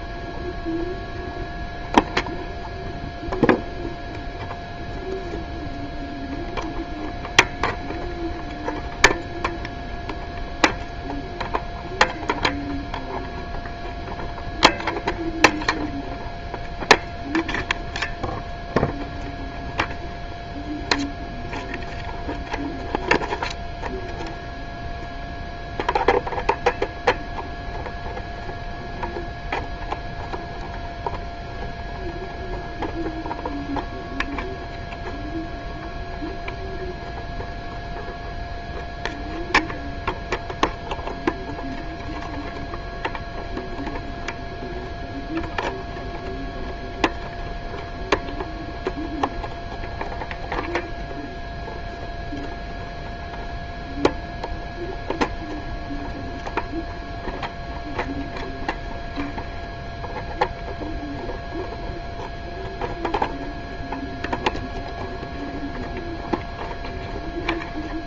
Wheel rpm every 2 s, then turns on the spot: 0, 0, 0, 0, 0, 0, 0, 0, 0, 0, 0, 0, 0, 0, 0, 0, 0, 0, 0, 0, 0, 0, 0, 0, 0, 0, 0, 0, 0, 0, 0, 0, 0, 0.
none